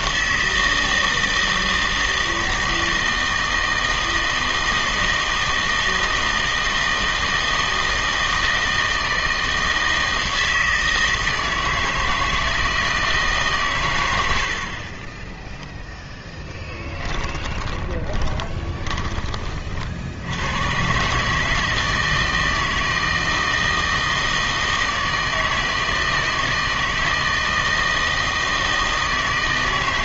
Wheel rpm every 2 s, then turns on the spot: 160, 160, 160, 160, 160, 160, 160, 60, 10, 20, 110, 160, 160, 160, 160.
16-20